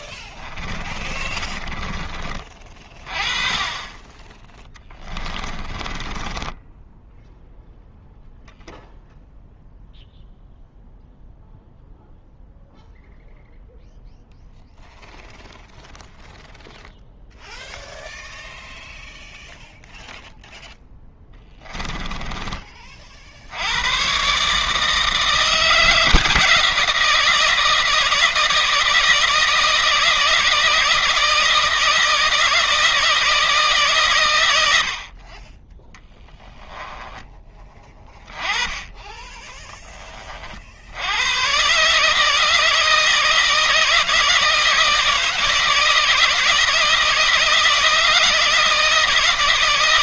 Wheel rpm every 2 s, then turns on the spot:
20, 30, 10, 10, 0, 0, 0, 0, 0, 0, 10, 30, 160, 170, 160, 160, 160, 70, 10, 20, 80, 160, 160, 170, 160.
0-2 4-8 20-22 36-38